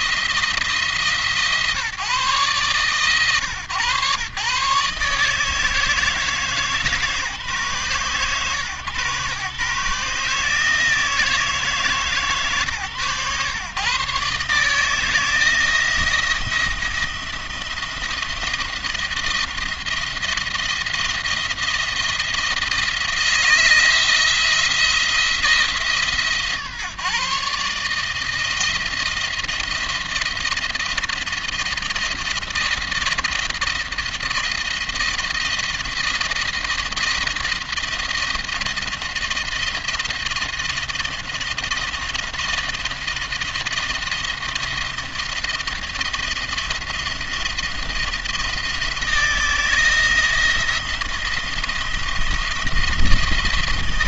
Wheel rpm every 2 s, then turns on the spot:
160, 130, 140, 150, 130, 160, 140, 150, 170, 170, 170, 160, 170, 140, 160, 170, 170, 170, 170, 160, 170, 170, 170, 170, 170, 170, 170.
none